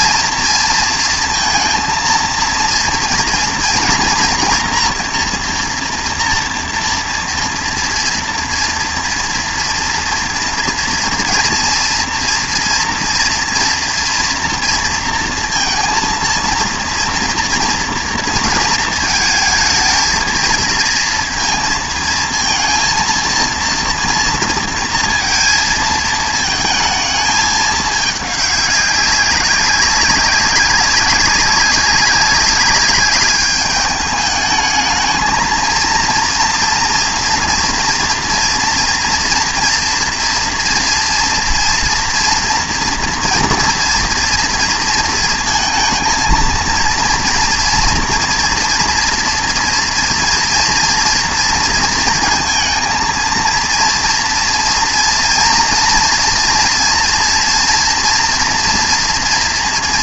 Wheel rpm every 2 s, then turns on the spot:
230, 230, 230, 240, 240, 230, 230, 230, 230, 230, 230, 230, 230, 220, 200, 190, 200, 210, 230, 230, 230, 230, 230, 230, 230, 230, 230, 230, 230, 240.
none